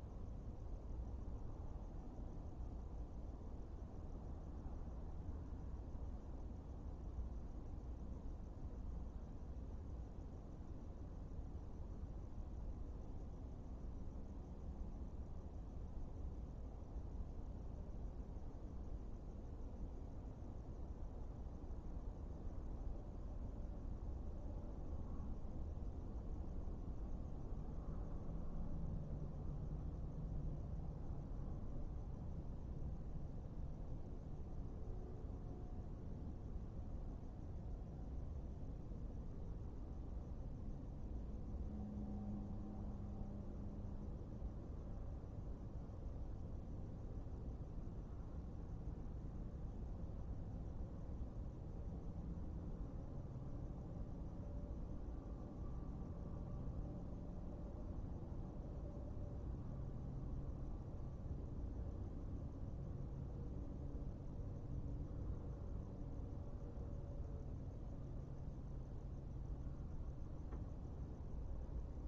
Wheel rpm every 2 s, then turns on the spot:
0, 0, 0, 0, 0, 0, 0, 0, 0, 0, 0, 0, 0, 0, 0, 0, 0, 0, 0, 0, 0, 0, 0, 0, 0, 0, 0, 0, 0, 0, 0, 0, 0, 0, 0, 0.
none